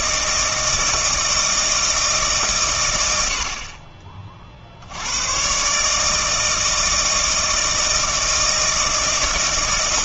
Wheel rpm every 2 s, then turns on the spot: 160, 140, 50, 160, 160.
none